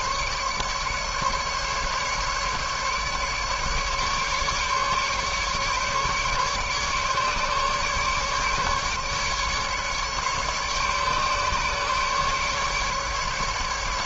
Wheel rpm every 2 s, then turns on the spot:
150, 150, 150, 150, 150, 140, 150.
none